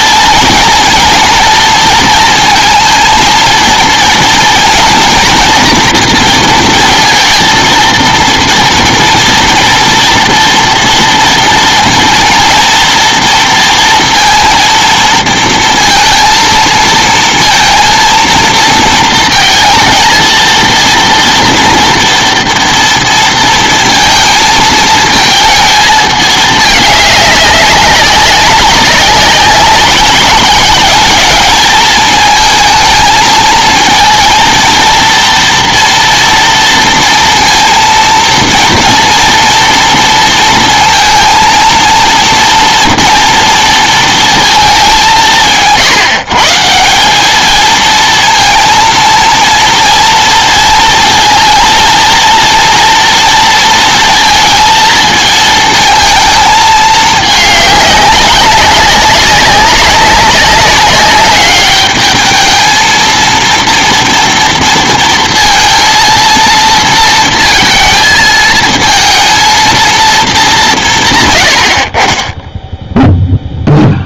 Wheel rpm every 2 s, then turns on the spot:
230, 230, 230, 230, 230, 230, 230, 230, 230, 220, 230, 230, 220, 210, 190, 200, 220, 230, 230, 230, 230, 230, 210, 170, 230, 230, 230, 230, 220, 190, 200, 220, 230, 230, 220, 170, 0.
none